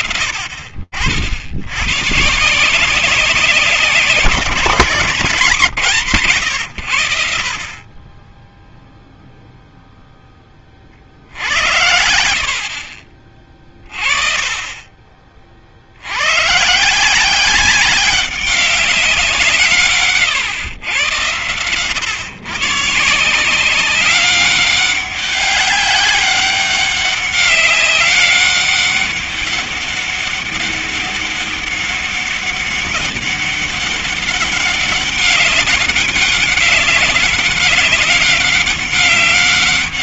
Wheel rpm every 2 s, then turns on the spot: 90, 170, 150, 30, 0, 90, 40, 50, 190, 150, 120, 190, 200, 200, 200, 200, 200, 190, 190, 190.
none